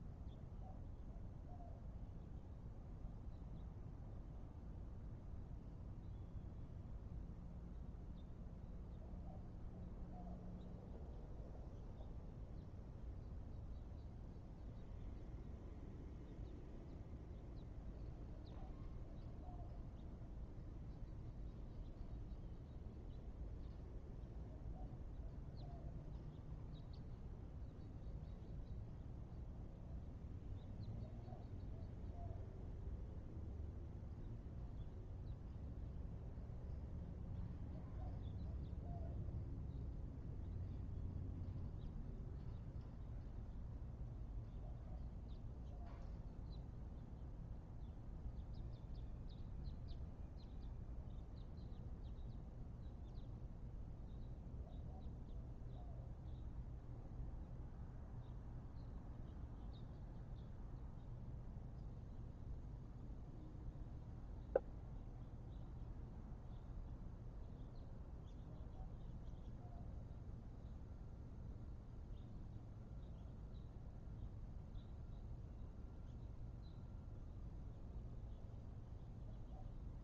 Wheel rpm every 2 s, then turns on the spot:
0, 0, 0, 0, 0, 0, 0, 0, 0, 0, 0, 0, 0, 0, 0, 0, 0, 0, 0, 0, 0, 0, 0, 0, 0, 0, 0, 0, 0, 0, 0, 0, 0, 0, 0, 0, 0, 0, 0, 0.
none